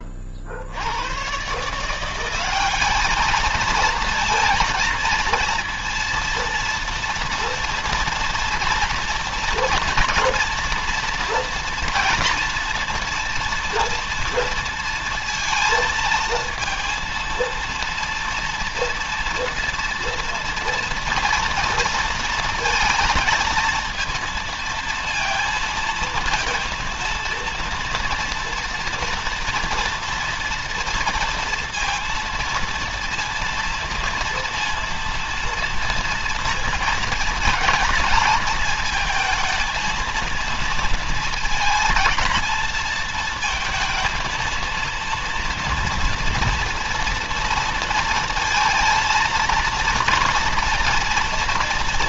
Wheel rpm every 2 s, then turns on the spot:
90, 210, 230, 230, 240, 240, 230, 230, 230, 230, 230, 230, 230, 230, 230, 230, 230, 230, 220, 220, 230, 220, 230, 230, 220, 230.
none